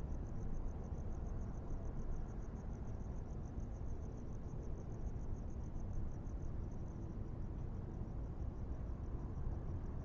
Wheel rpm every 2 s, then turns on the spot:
0, 0, 0, 0, 0.
none